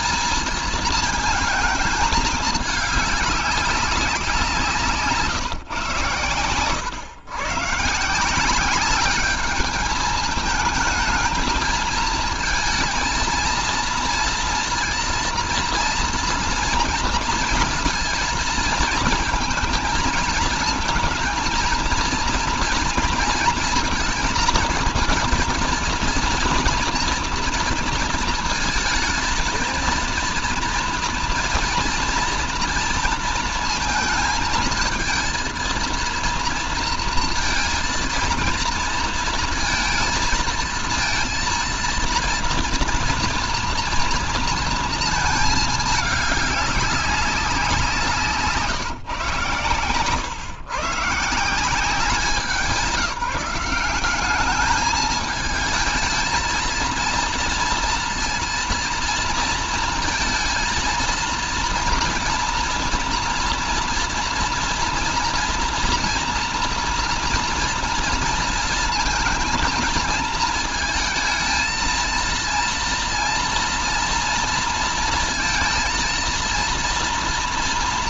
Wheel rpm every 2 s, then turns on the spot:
220, 210, 180, 120, 190, 220, 230, 230, 240, 230, 220, 230, 230, 230, 220, 230, 230, 220, 230, 230, 230, 230, 230, 200, 150, 140, 200, 210, 230, 230, 230, 230, 230, 230, 230, 220, 230, 230, 230.
none